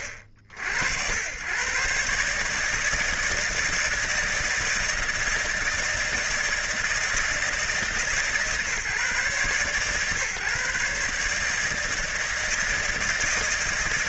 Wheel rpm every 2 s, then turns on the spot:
70, 150, 160, 160, 150, 140, 160.
none